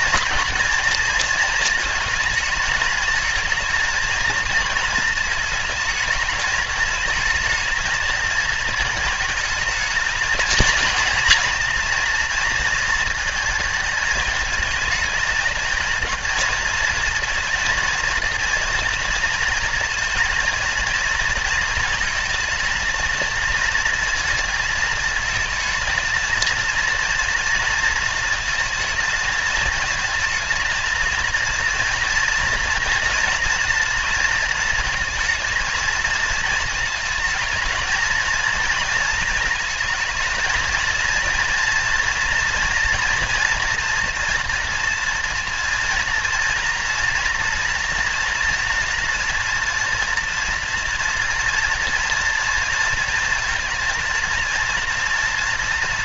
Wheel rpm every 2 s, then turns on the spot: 230, 220, 220, 220, 230, 230, 230, 220, 220, 230, 230, 220, 230, 230, 230, 230, 230, 230, 220, 230, 220, 230, 230, 240, 230, 230, 230, 230.
none